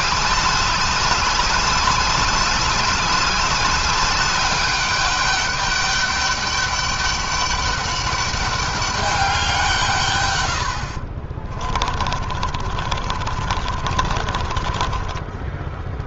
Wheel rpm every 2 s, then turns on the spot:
200, 200, 200, 200, 200, 70, 30, 20.
10-16